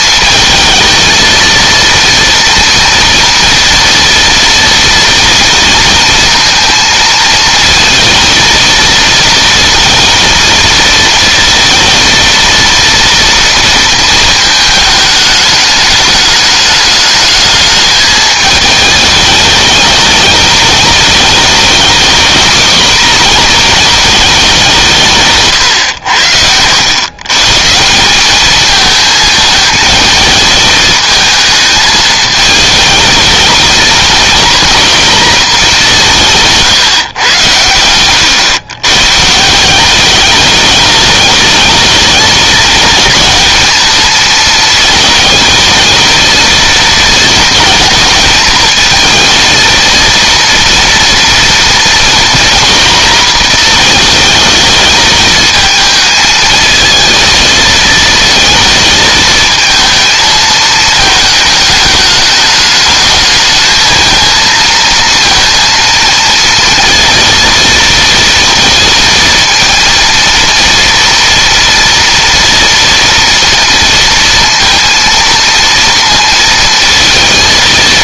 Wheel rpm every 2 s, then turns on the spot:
230, 230, 230, 230, 230, 230, 230, 210, 210, 210, 210, 230, 150, 120, 220, 220, 220, 240, 130, 140, 210, 220, 220, 230, 220, 230, 240, 220, 220, 220, 220, 220, 230, 230, 230, 230, 230, 230, 230.
none